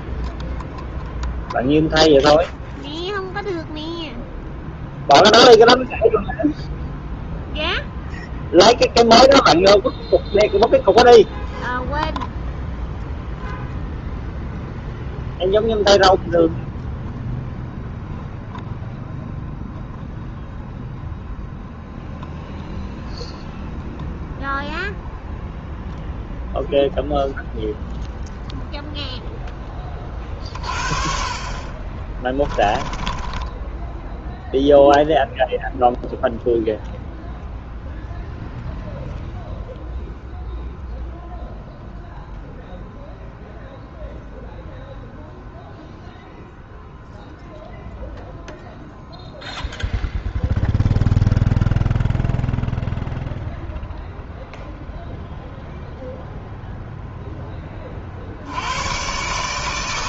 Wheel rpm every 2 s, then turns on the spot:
0, 0, 0, 0, 0, 0, 0, 0, 0, 0, 0, 0, 0, 0, 0, 30, 30, 0, 0, 0, 0, 0, 0, 0, 0, 0, 0, 0, 0, 90.
32-34